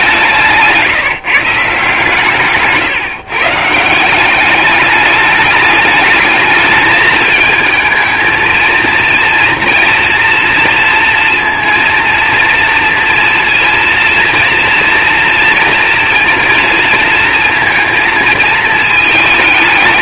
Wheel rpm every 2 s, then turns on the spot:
170, 140, 200, 210, 220, 230, 230, 230, 230, 220.
2-4